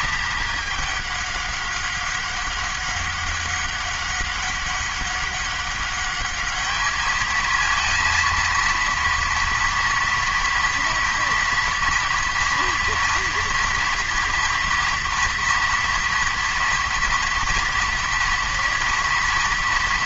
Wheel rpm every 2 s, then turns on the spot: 210, 200, 190, 210, 230, 230, 230, 230, 230, 240.
none